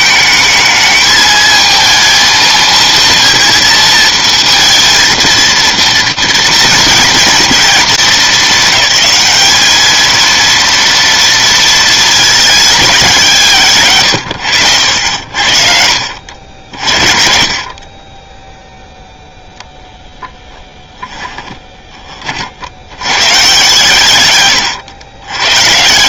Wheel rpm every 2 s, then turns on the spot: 220, 230, 230, 230, 210, 230, 200, 90, 60, 0, 20, 130, 100.
20-22